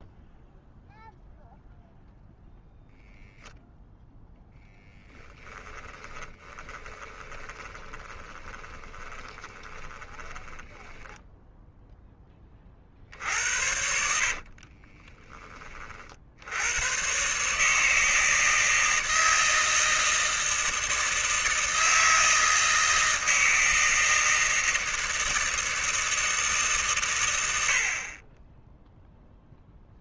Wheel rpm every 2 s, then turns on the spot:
0, 0, 0, 20, 20, 20, 40, 30, 100, 160, 160, 160, 160, 140, 10.
6-12 14-16